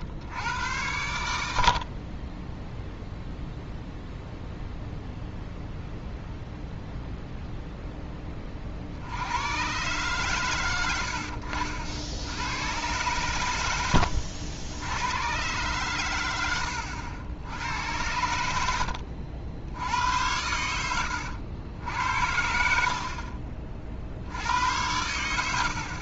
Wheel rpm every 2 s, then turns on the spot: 90, 10, 0, 0, 40, 110, 110, 80, 90, 70, 90, 60, 90.
16-18